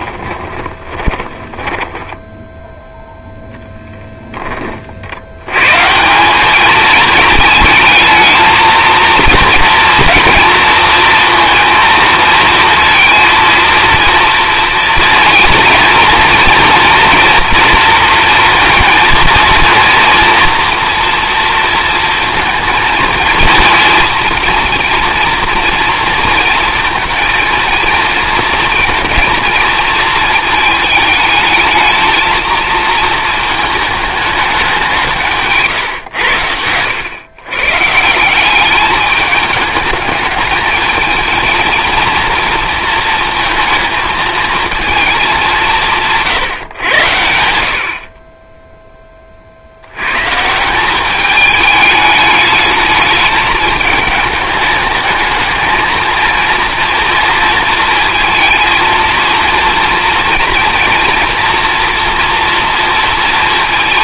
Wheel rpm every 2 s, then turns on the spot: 20, 10, 30, 210, 220, 230, 230, 230, 230, 230, 230, 230, 230, 230, 230, 220, 230, 210, 100, 200, 220, 230, 220, 130, 10, 180, 210, 210, 230, 220, 230, 230.
0-2